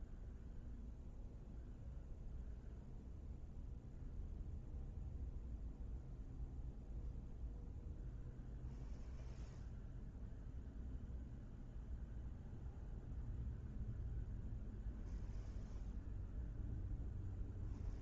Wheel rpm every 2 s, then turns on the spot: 0, 0, 0, 0, 0, 0, 0, 0, 0.
none